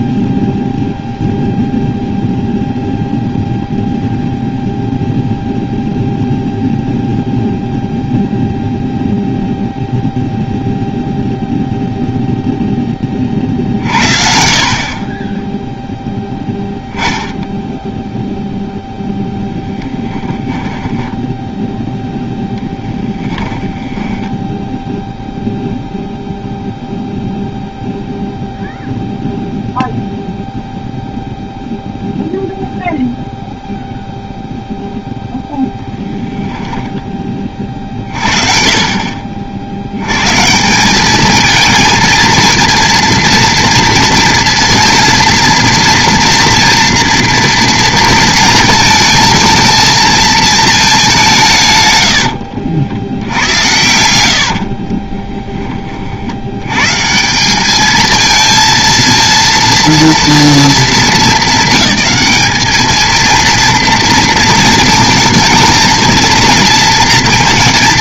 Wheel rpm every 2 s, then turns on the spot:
0, 0, 0, 0, 0, 0, 40, 30, 10, 0, 10, 20, 0, 0, 0, 0, 0, 0, 10, 50, 200, 230, 230, 230, 230, 200, 70, 40, 140, 230, 220, 220, 220, 230.
22-24 54-56